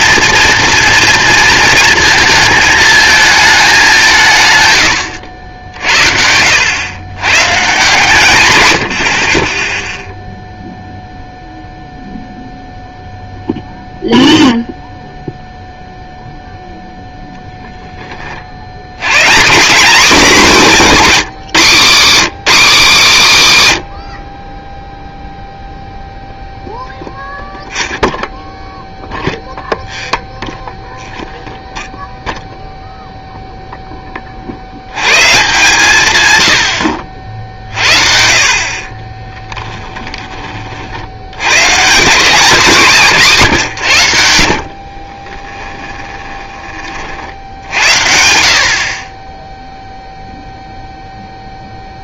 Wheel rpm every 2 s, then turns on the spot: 230, 220, 120, 100, 100, 0, 0, 0, 0, 80, 220, 230, 20, 0, 0, 0, 0, 80, 90, 50, 40, 190, 60, 30, 60, 0.
44-46